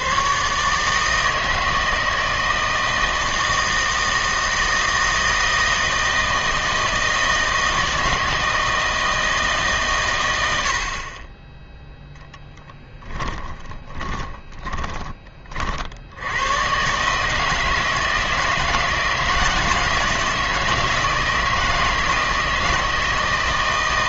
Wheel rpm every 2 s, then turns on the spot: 150, 160, 160, 160, 160, 70, 10, 20, 120, 160, 160, 160.
12-16